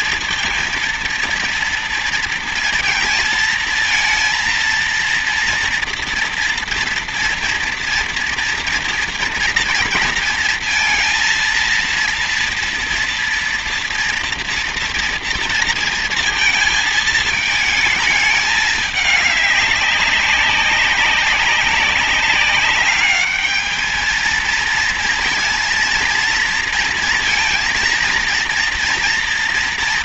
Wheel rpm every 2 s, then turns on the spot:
230, 230, 230, 230, 230, 230, 230, 230, 220, 210, 200, 200, 230, 230, 230.
none